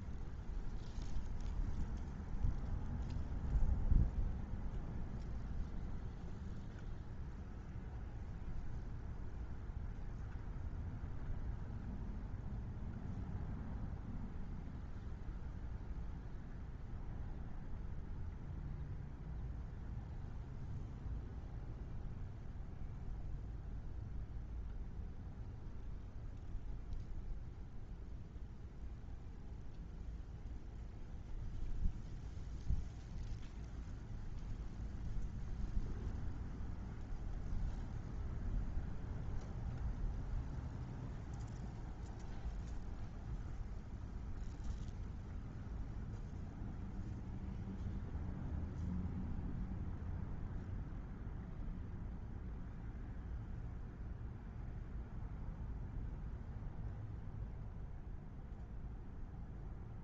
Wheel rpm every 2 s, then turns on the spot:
0, 0, 0, 0, 0, 0, 0, 0, 0, 0, 0, 0, 0, 0, 0, 0, 0, 0, 0, 0, 0, 0, 0, 0, 0, 0, 0, 0, 0, 0.
none